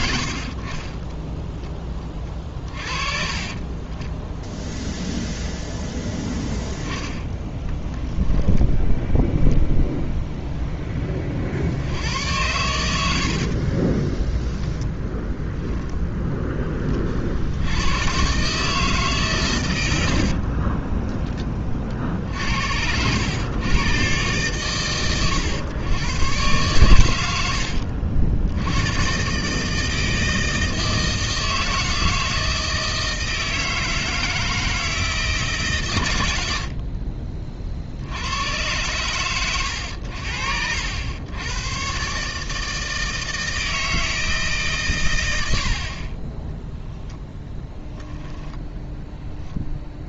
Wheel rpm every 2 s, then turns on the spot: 40, 40, 0, 10, 10, 10, 90, 0, 30, 150, 20, 70, 120, 110, 100, 160, 160, 160, 60, 110, 80, 160, 140, 10, 10.
6-10 20-22